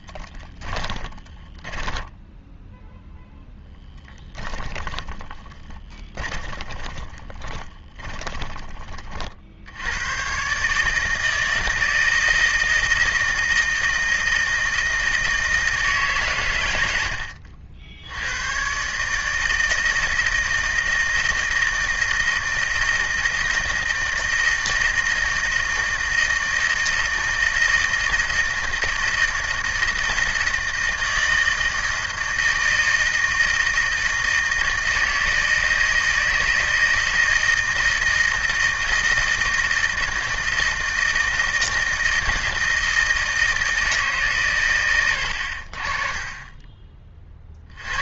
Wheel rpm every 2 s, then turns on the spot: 20, 0, 10, 20, 20, 140, 160, 160, 110, 110, 160, 160, 160, 160, 160, 160, 160, 160, 160, 160, 160, 160, 120, 20.
0-2 4-8